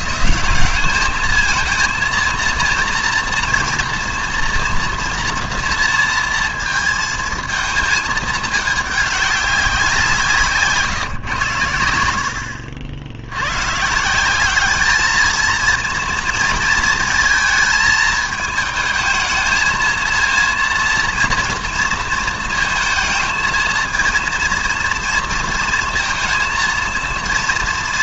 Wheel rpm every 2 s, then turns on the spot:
180, 230, 230, 230, 210, 160, 60, 210, 230, 220, 230, 220, 230, 230.
none